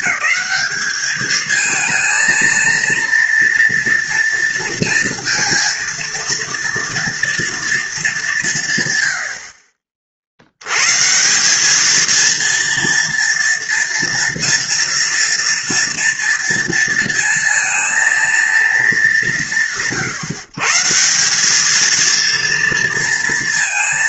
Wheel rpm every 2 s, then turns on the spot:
220, 230, 230, 230, 120, 110, 230, 230, 230, 220, 150, 230.
none